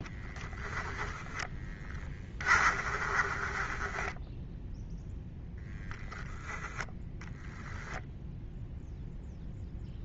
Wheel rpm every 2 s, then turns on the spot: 10, 30, 0, 10, 0.
0-4